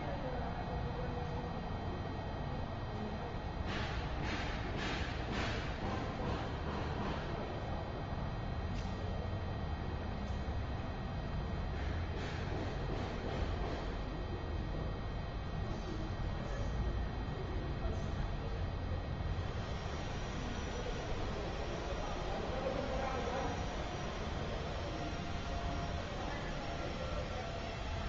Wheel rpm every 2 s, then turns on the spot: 0, 0, 0, 0, 0, 0, 0, 0, 0, 0, 0, 0, 0, 0.
none